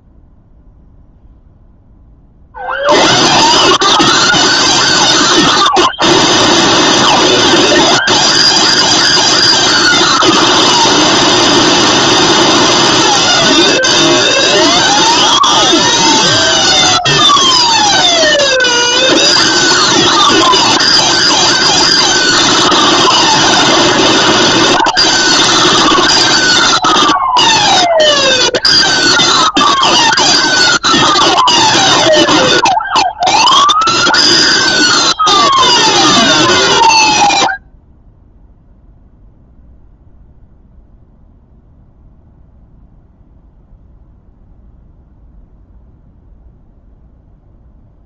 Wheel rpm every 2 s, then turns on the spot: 0, 0, 0, 0, 0, 0, 0, 0, 0, 0, 0, 0, 0, 0, 0, 0, 0, 0, 0, 0, 0, 0, 0, 0.
none